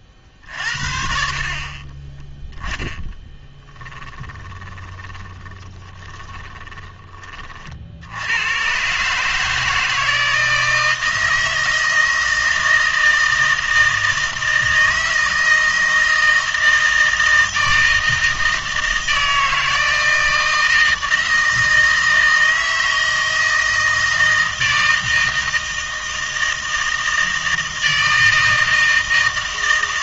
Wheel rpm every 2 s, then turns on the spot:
50, 10, 10, 20, 120, 160, 160, 160, 160, 160, 160, 160, 160, 160, 160.
4-8